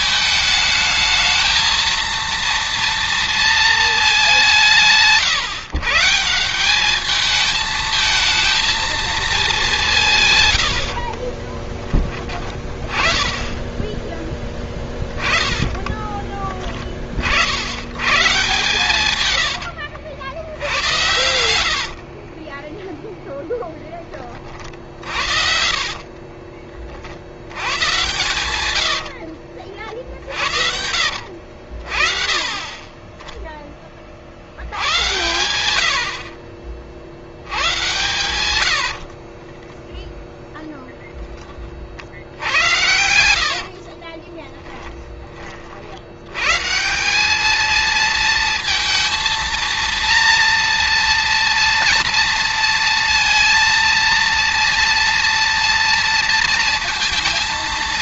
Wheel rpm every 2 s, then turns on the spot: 220, 230, 130, 220, 200, 30, 20, 20, 50, 110, 90, 0, 50, 50, 70, 80, 20, 100, 70, 60, 10, 80, 10, 160, 230, 230, 230, 230, 230.
10-12 14-16 18-22 24-26 28-30 38-40 42-44